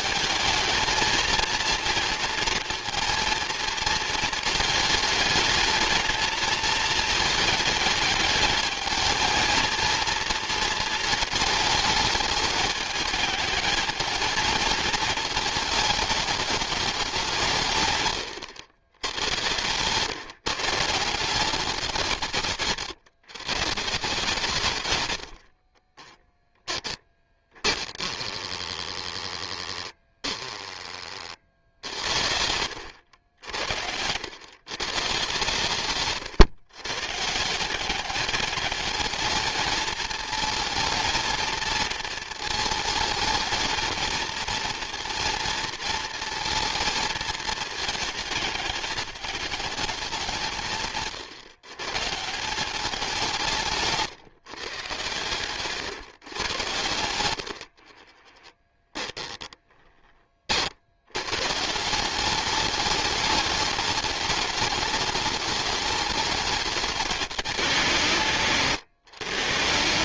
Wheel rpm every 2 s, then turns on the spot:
220, 230, 220, 220, 220, 230, 210, 220, 200, 100, 160, 160, 130, 10, 10, 20, 90, 120, 130, 210, 230, 220, 230, 230, 210, 150, 190, 140, 110, 10, 70, 210, 210, 210, 150.
26-28 56-60